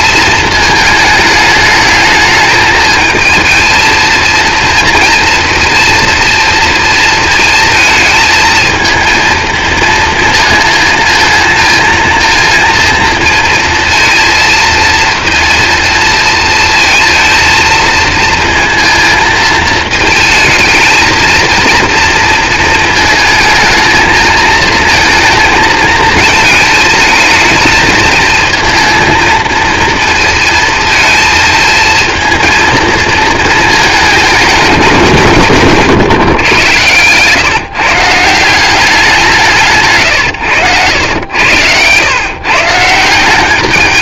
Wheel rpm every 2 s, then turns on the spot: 220, 220, 230, 230, 220, 220, 230, 230, 230, 230, 220, 230, 230, 220, 230, 220, 220, 190, 120, 180, 100, 160.
none